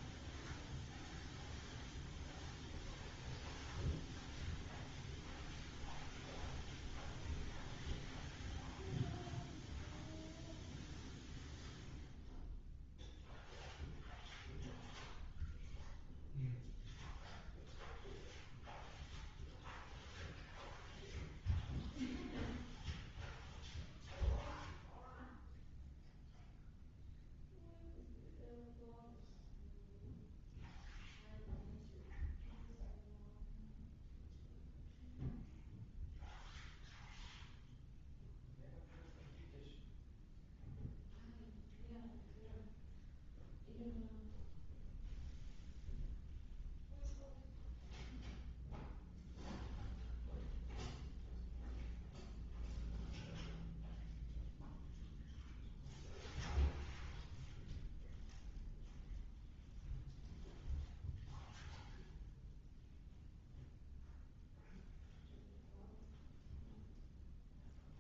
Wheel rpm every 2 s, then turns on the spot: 0, 0, 0, 0, 0, 0, 0, 0, 0, 0, 0, 0, 0, 0, 0, 0, 0, 0, 0, 0, 0, 0, 0, 0, 0, 0, 0, 0, 0, 0, 0, 0, 0, 0.
none